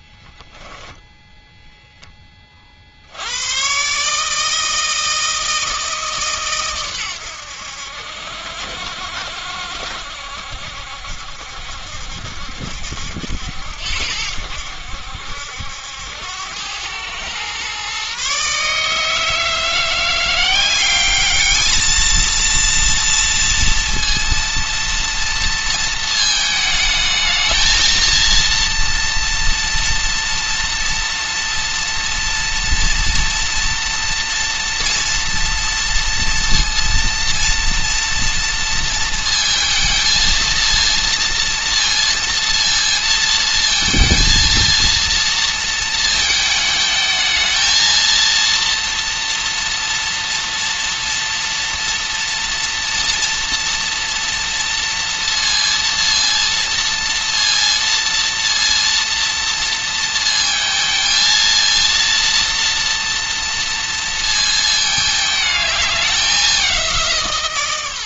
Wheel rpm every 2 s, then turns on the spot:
10, 30, 160, 140, 70, 70, 70, 80, 100, 150, 190, 230, 230, 220, 230, 230, 230, 230, 230, 230, 230, 230, 230, 220, 230, 230, 230, 230, 230, 230, 230, 230, 220, 190.
none